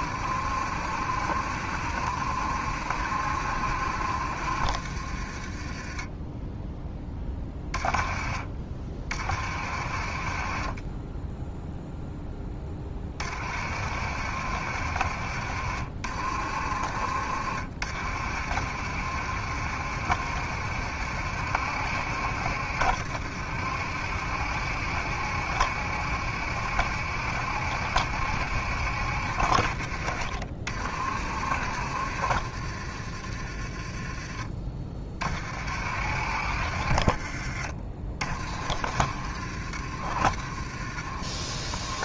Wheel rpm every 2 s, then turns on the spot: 70, 70, 60, 10, 40, 40, 20, 70, 60, 70, 70, 70, 70, 70, 70, 50, 60, 30, 50, 50, 50.
none